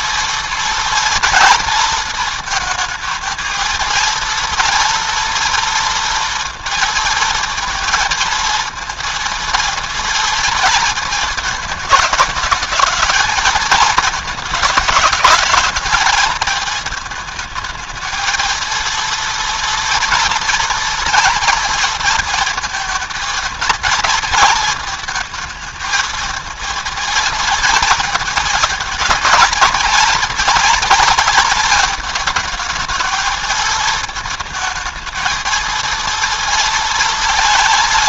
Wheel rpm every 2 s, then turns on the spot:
230, 220, 230, 230, 230, 230, 220, 210, 220, 230, 230, 230, 220, 230, 220, 230, 220, 220, 230.
none